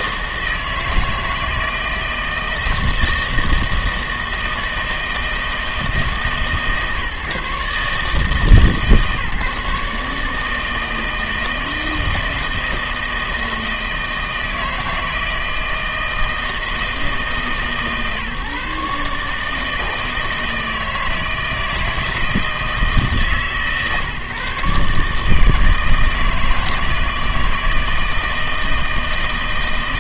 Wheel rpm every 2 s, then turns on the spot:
160, 160, 160, 150, 150, 160, 160, 160, 160, 150, 160, 160, 140, 160, 160.
none